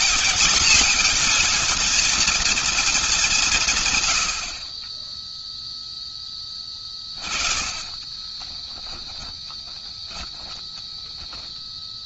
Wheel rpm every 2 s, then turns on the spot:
230, 230, 110, 10, 20, 10.
8-12